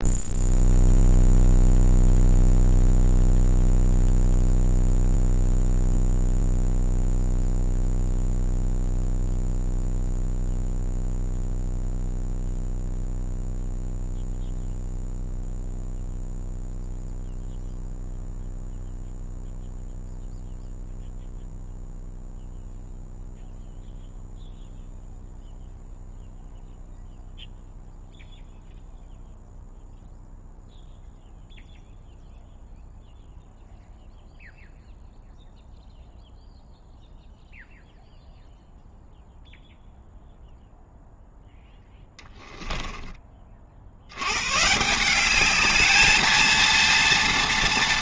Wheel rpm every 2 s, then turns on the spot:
0, 0, 0, 0, 0, 0, 0, 0, 0, 0, 0, 0, 0, 0, 0, 0, 0, 0, 0, 0, 0, 10, 140, 220.
none